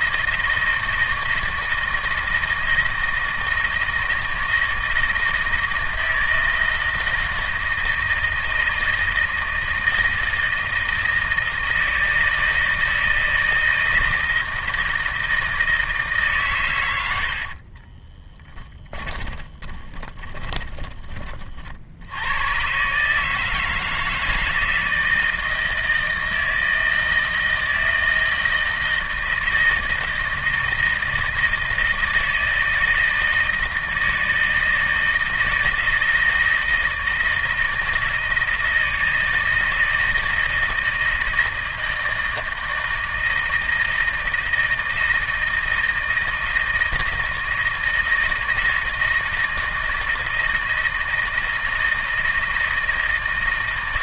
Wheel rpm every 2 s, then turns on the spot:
160, 160, 160, 160, 160, 160, 160, 160, 110, 20, 20, 120, 160, 160, 170, 160, 160, 160, 160, 160, 160, 160, 160, 160, 160, 160, 160.
18-22